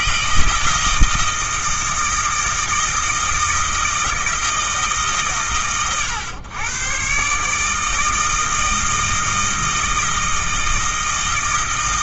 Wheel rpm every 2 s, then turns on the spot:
160, 160, 160, 110, 160, 160.
none